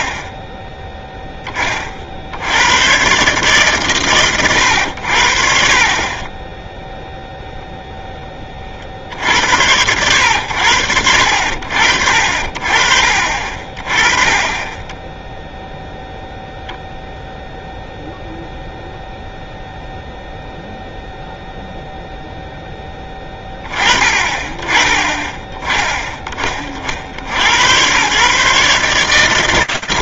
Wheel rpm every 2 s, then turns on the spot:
10, 140, 80, 0, 70, 70, 40, 0, 0, 0, 0, 20, 20, 80, 150.
none